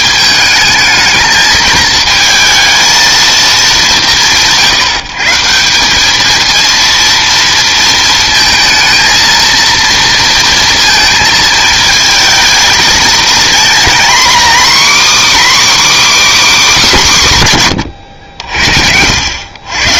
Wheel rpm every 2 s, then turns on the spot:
210, 230, 160, 230, 230, 230, 230, 270, 270, 80.
none